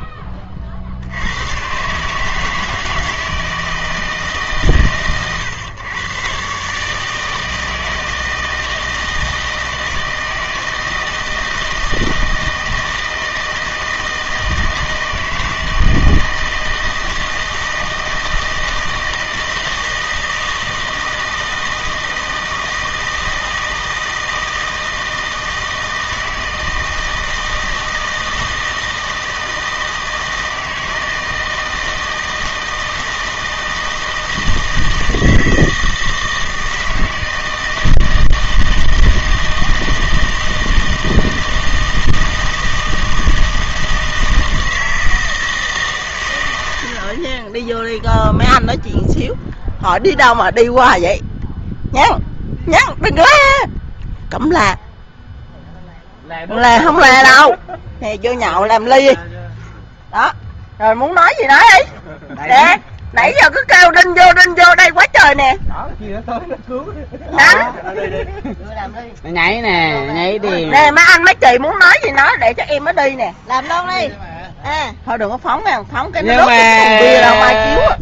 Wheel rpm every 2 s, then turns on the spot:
40, 160, 140, 130, 160, 160, 160, 160, 160, 160, 160, 160, 160, 160, 160, 160, 160, 160, 160, 160, 160, 160, 160, 90, 0, 0, 0, 0, 0, 0, 0, 0, 0, 0, 0, 0, 0, 0, 0.
none